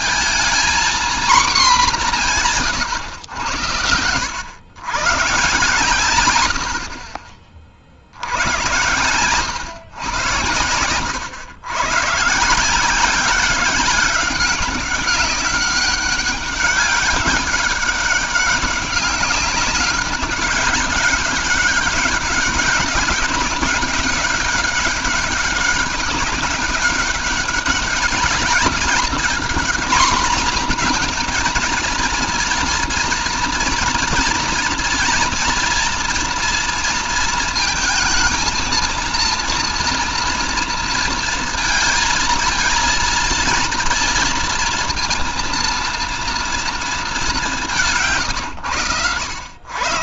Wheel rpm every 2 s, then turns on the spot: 240, 140, 130, 70, 90, 90, 170, 200, 200, 200, 200, 200, 200, 200, 200, 230, 230, 230, 230, 230, 230, 230, 230, 230, 120.
none